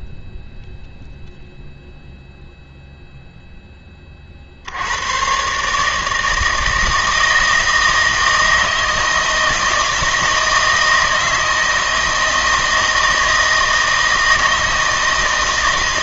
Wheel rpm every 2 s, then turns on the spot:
0, 0, 70, 160, 160, 160, 160, 160.
none